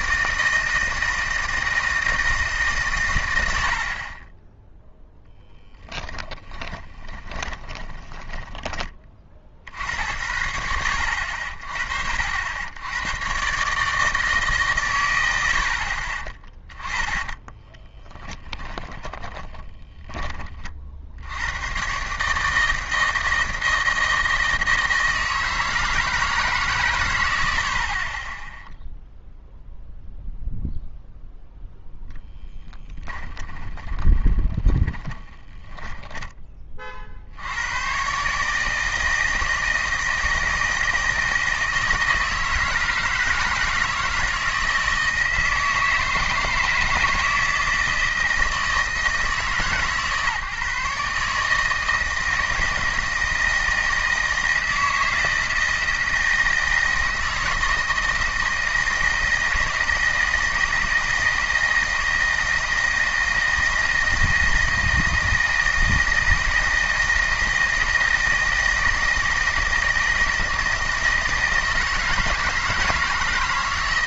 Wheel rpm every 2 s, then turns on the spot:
160, 140, 10, 20, 10, 80, 70, 140, 20, 10, 40, 160, 160, 150, 10, 0, 20, 20, 30, 160, 160, 160, 170, 160, 160, 150, 160, 160, 160, 160, 160, 160, 160, 160, 160, 160, 160.
6-10 16-20 32-36